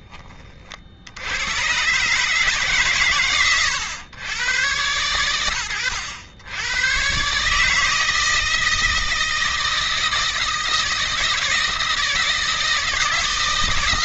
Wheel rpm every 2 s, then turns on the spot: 40, 150, 130, 100, 160, 160, 170.
none